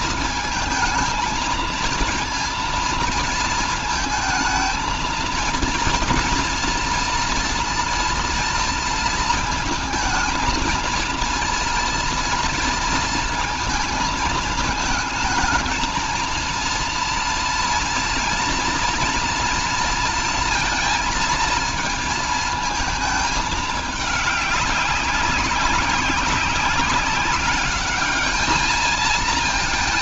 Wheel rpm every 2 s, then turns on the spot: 220, 230, 220, 240, 230, 230, 230, 220, 230, 240, 230, 220, 200, 190, 220.
none